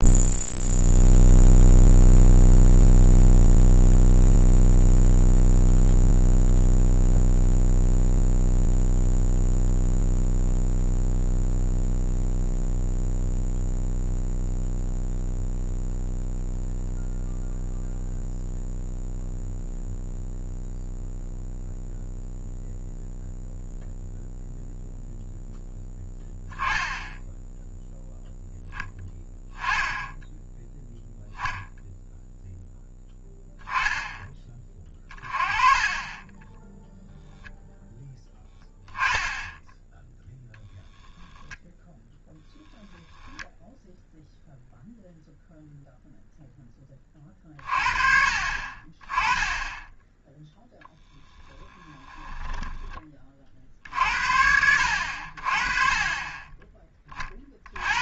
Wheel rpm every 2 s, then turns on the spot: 0, 0, 0, 0, 0, 0, 0, 0, 0, 0, 0, 0, 0, 0, 10, 10, 0, 30, 10, 10, 0, 0, 0, 20, 30, 0, 20, 70, 30.
36-38